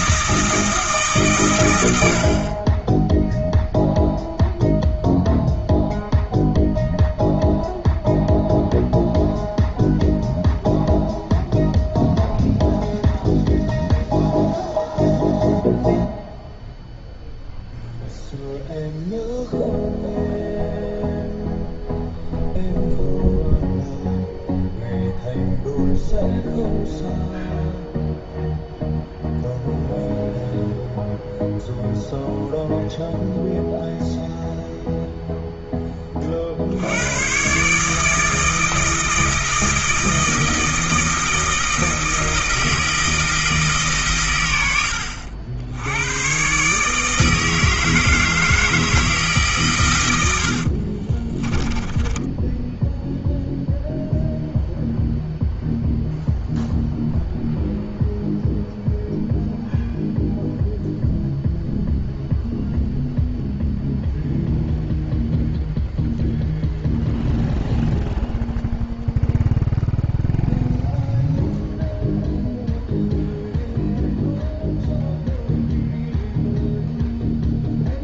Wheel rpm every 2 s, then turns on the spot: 160, 20, 0, 0, 0, 0, 0, 0, 0, 0, 0, 0, 0, 0, 0, 0, 0, 0, 80, 160, 160, 160, 80, 150, 160, 40, 0, 0, 0, 0, 0, 0, 0, 0, 0, 0, 0, 0, 0.
50-52